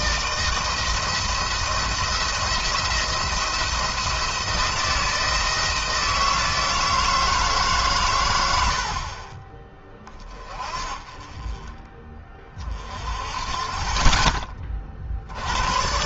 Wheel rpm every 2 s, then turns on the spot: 160, 170, 170, 160, 60, 30, 40, 40.
none